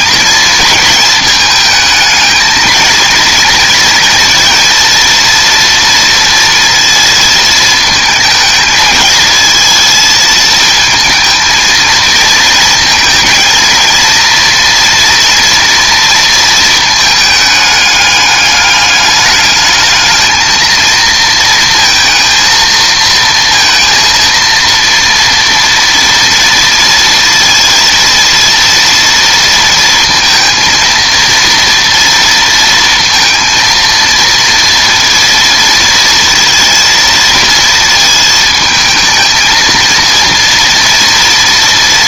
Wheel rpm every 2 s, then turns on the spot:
220, 220, 230, 230, 220, 220, 230, 230, 230, 210, 220, 230, 230, 230, 230, 230, 230, 230, 230, 220, 230.
none